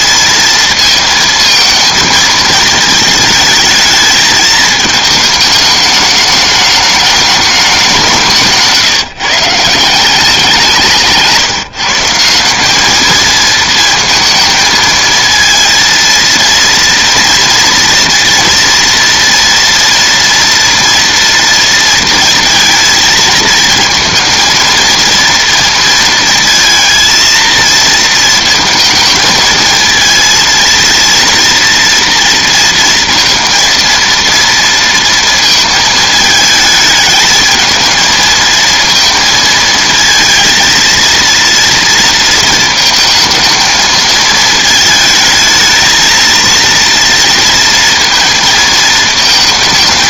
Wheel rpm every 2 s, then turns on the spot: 230, 220, 220, 210, 160, 180, 200, 230, 230, 240, 230, 230, 230, 230, 220, 230, 230, 230, 220, 220, 230, 230, 220, 230, 230.
none